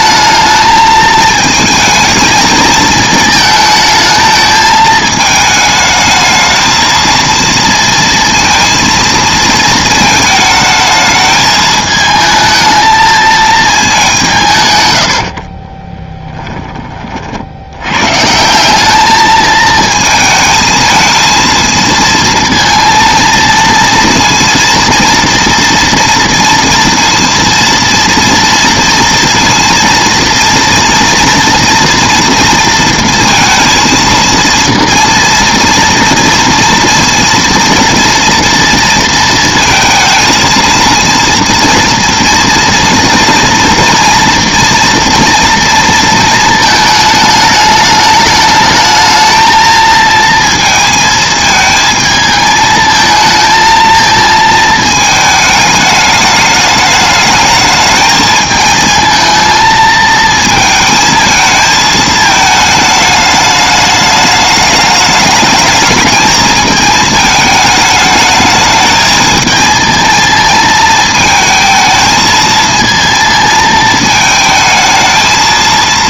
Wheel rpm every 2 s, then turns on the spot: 220, 220, 220, 220, 230, 220, 220, 140, 20, 180, 220, 230, 230, 230, 230, 230, 230, 230, 230, 230, 230, 230, 240, 220, 210, 230, 220, 220, 210, 220, 220, 210, 210, 220, 220, 220, 220, 220.
none